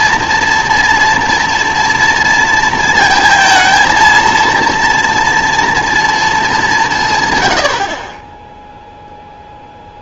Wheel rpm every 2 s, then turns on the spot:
230, 230, 230, 190, 0.
none